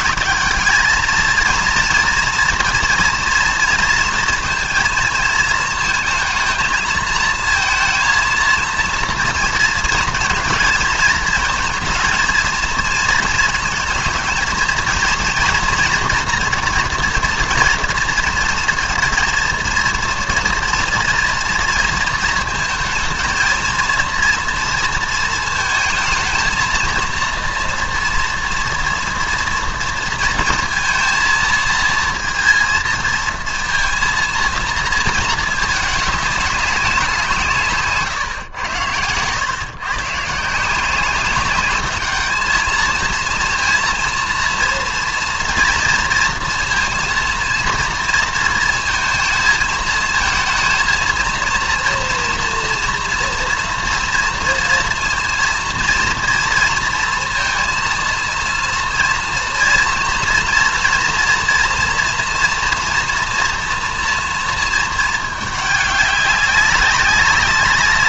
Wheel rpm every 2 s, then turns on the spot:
220, 230, 230, 220, 230, 220, 230, 230, 240, 230, 230, 230, 230, 220, 230, 230, 230, 230, 190, 110, 170, 220, 230, 230, 230, 230, 230, 230, 230, 230, 230, 230, 230, 190.
none